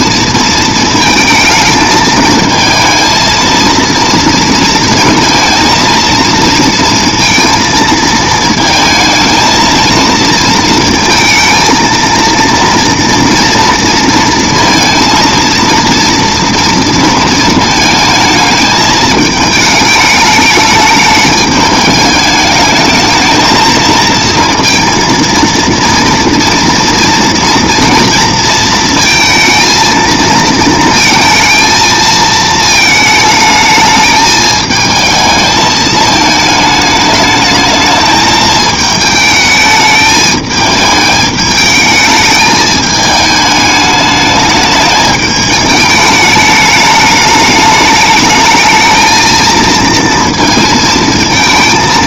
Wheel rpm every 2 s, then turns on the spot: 220, 220, 230, 230, 220, 230, 230, 230, 230, 220, 210, 220, 230, 230, 230, 230, 220, 220, 220, 220, 210, 220, 210, 210, 220, 230.
none